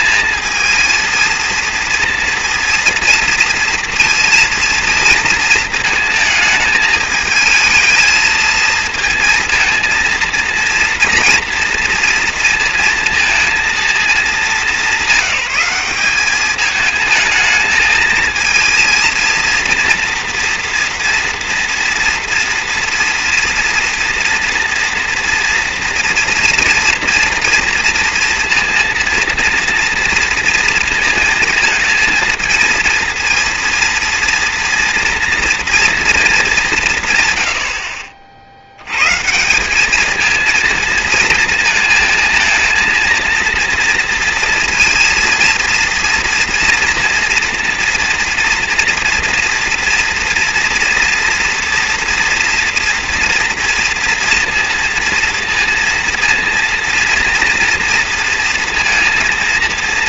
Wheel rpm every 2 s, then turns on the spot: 220, 230, 230, 220, 220, 230, 230, 210, 220, 230, 230, 230, 230, 240, 230, 230, 230, 230, 200, 70, 220, 230, 230, 230, 240, 240, 230, 230, 230, 230.
none